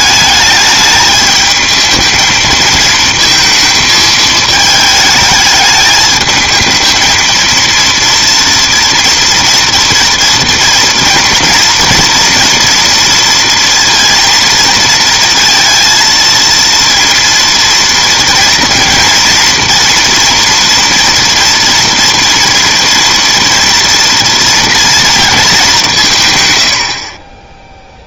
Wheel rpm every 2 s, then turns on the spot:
210, 230, 220, 220, 230, 230, 240, 230, 230, 230, 240, 230, 230, 90.
none